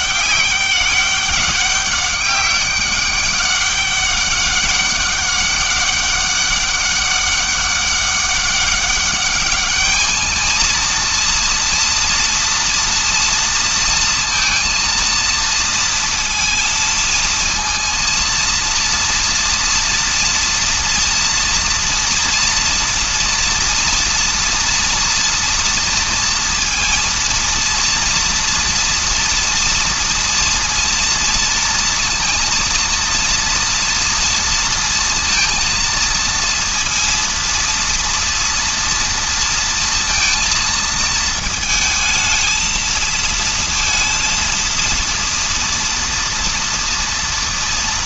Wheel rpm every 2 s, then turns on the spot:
200, 200, 200, 200, 200, 230, 230, 230, 230, 230, 230, 230, 230, 230, 230, 230, 230, 230, 230, 230, 220, 220, 230, 230.
none